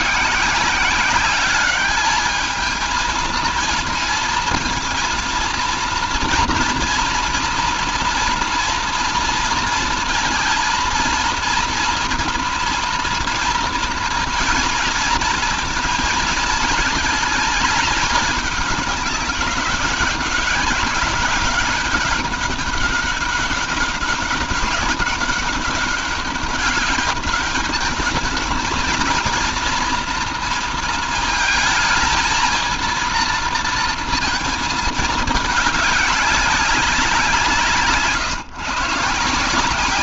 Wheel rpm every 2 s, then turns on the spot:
190, 230, 230, 230, 230, 230, 240, 230, 220, 200, 190, 200, 200, 200, 220, 230, 230, 220, 190, 140.
none